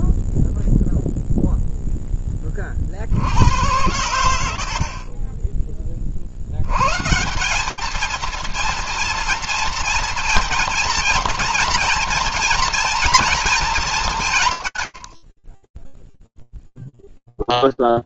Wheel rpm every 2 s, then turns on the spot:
0, 50, 40, 150, 230, 240, 240, 80, 0.
none